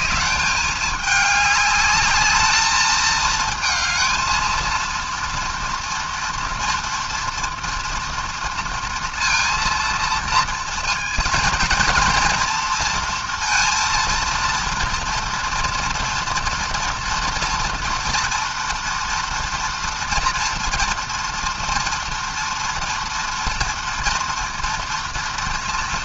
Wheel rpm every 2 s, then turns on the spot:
200, 220, 230, 230, 230, 230, 230, 230, 230, 230, 230, 230, 230.
none